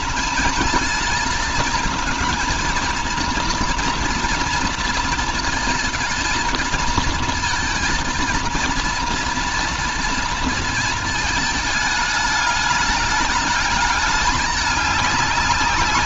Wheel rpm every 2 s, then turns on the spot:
220, 230, 230, 230, 230, 220, 210, 210.
none